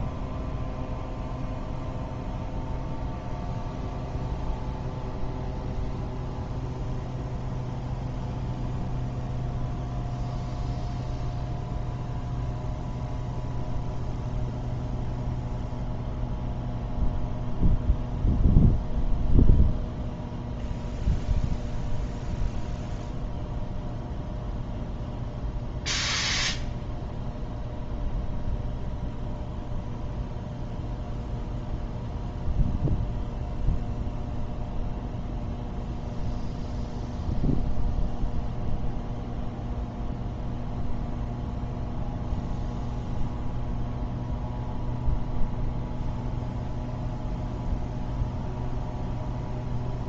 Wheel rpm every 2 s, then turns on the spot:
0, 0, 0, 0, 0, 0, 0, 0, 0, 0, 0, 0, 0, 0, 0, 0, 0, 0, 0, 0, 0, 0, 0, 0, 0.
none